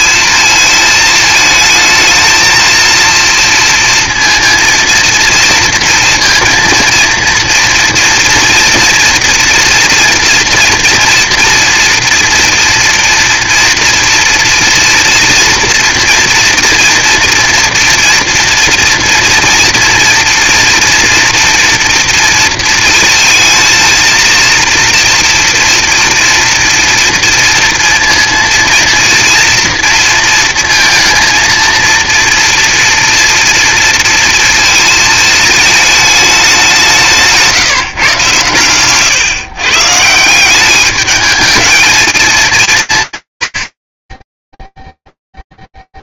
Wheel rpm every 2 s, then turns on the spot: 220, 220, 230, 230, 230, 230, 240, 230, 230, 230, 240, 230, 230, 230, 240, 220, 230, 220, 190, 120, 190, 210, 10.
none